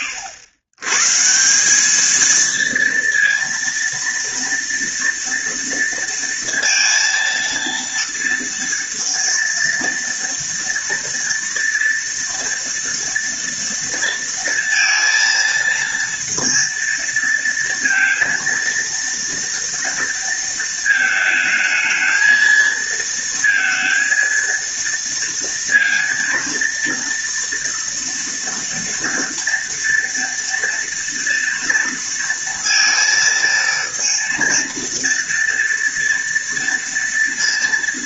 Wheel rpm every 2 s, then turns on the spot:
110, 230, 230, 230, 230, 230, 230, 230, 230, 230, 220, 230, 230, 230, 230, 230, 230, 230, 230.
none